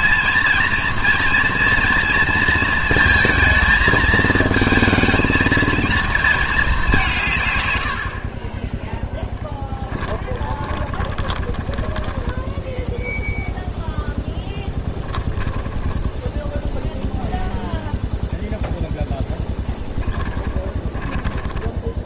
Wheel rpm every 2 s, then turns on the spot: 230, 230, 220, 210, 20, 20, 10, 10, 0, 0, 10.
8-16 20-22